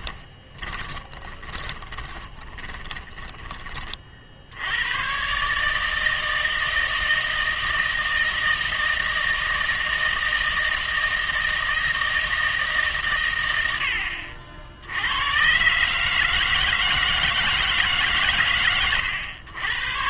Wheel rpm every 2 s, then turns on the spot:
20, 10, 90, 160, 160, 160, 150, 80, 160, 110.
0-4